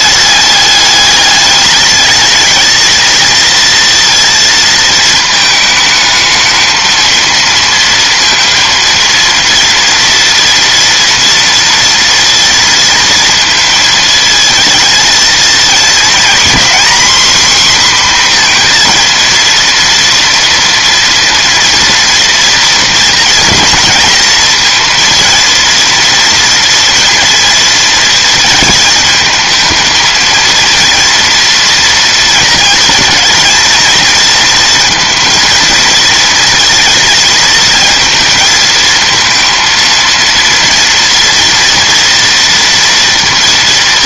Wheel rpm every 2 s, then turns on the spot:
210, 220, 230, 220, 230, 230, 230, 220, 260, 240, 230, 230, 230, 230, 220, 230, 230, 230, 230, 230, 230, 230.
none